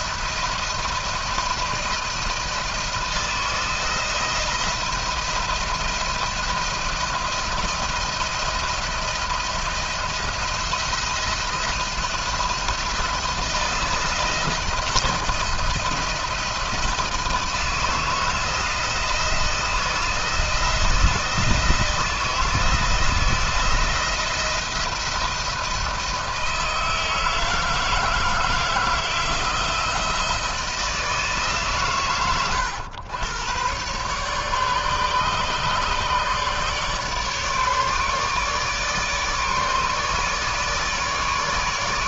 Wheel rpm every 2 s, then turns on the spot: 170, 160, 170, 160, 170, 170, 170, 160, 170, 170, 170, 170, 160, 160, 160, 160, 100, 140, 150, 150, 150.
none